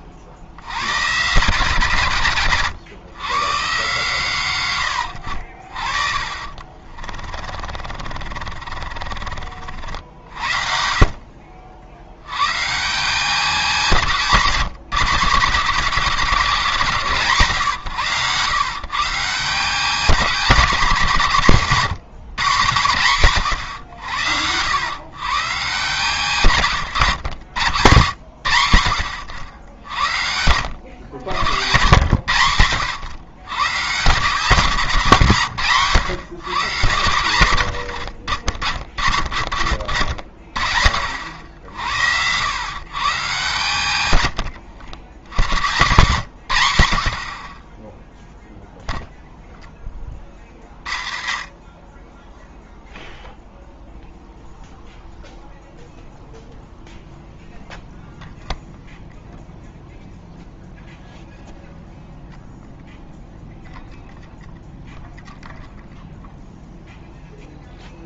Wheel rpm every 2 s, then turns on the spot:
90, 120, 100, 40, 40, 70, 130, 190, 170, 130, 220, 150, 90, 140, 80, 80, 100, 180, 140, 70, 50, 110, 90, 110, 0, 40, 0, 0, 0, 0, 0, 0, 0, 0.
6-10